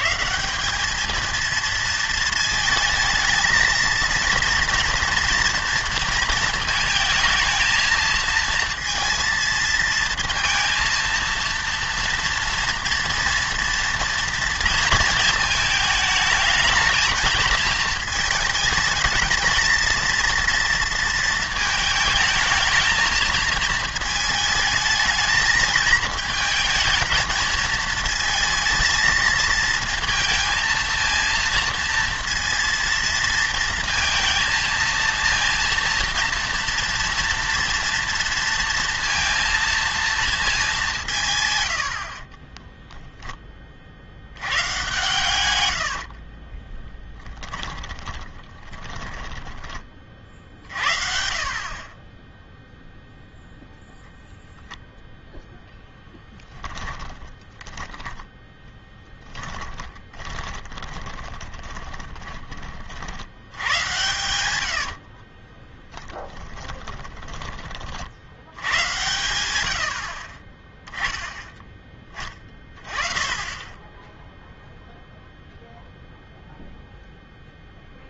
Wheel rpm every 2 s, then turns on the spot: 180, 220, 230, 220, 230, 230, 230, 230, 220, 220, 230, 220, 220, 220, 230, 220, 230, 230, 230, 230, 210, 10, 110, 20, 20, 50, 0, 0, 10, 10, 20, 30, 80, 20, 100, 10, 30, 0, 0.
42-44 46-50 56-62 64-68